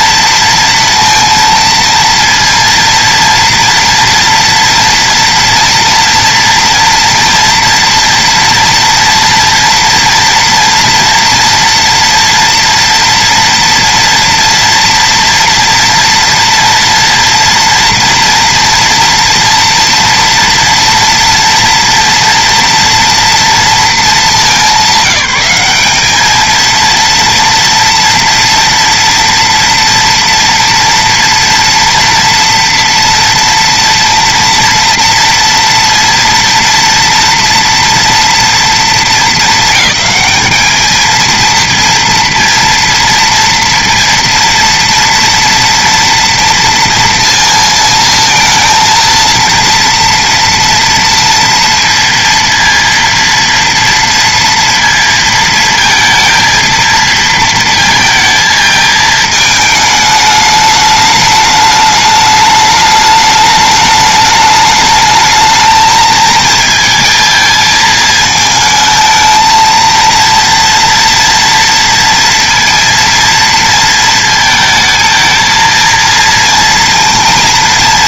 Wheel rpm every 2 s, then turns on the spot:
230, 230, 230, 230, 230, 240, 230, 240, 240, 230, 240, 230, 200, 220, 230, 230, 230, 230, 230, 230, 210, 230, 230, 230, 220, 230, 230, 230, 230, 230, 210, 210, 210, 220, 220, 230, 230, 230, 230.
none